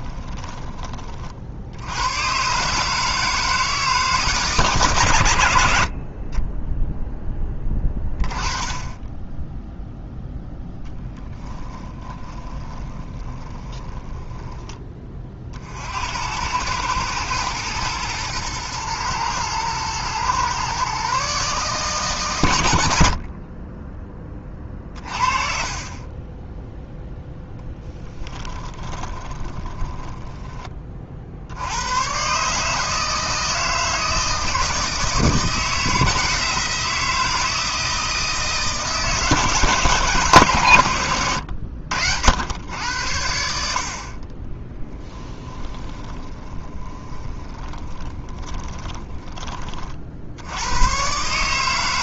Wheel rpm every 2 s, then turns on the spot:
30, 150, 120, 20, 20, 0, 20, 10, 100, 120, 130, 90, 30, 0, 10, 20, 150, 160, 170, 160, 130, 90, 20, 20, 20, 110.
12-14 24-26 28-30 44-50